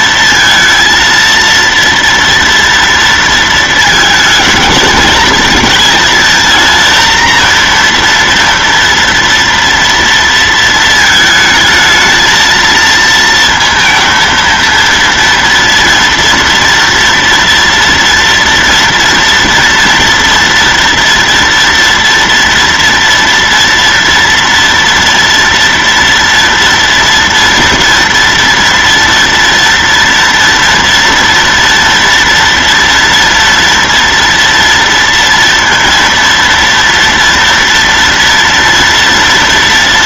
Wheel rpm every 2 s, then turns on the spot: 230, 230, 220, 230, 230, 230, 220, 230, 230, 230, 230, 230, 230, 230, 230, 230, 230, 230, 230, 230.
none